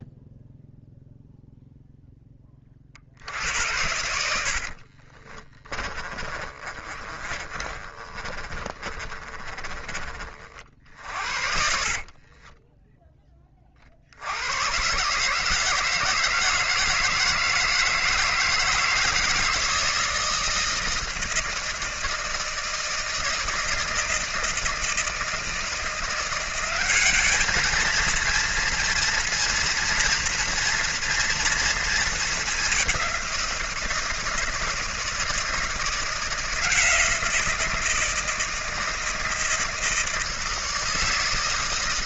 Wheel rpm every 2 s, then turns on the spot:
0, 50, 50, 30, 30, 60, 10, 140, 160, 160, 160, 160, 160, 200, 230, 230, 190, 160, 170, 160, 160.
4-12